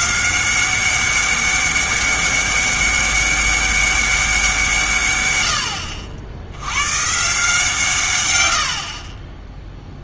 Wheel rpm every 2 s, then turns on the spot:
190, 200, 150, 110, 60.
none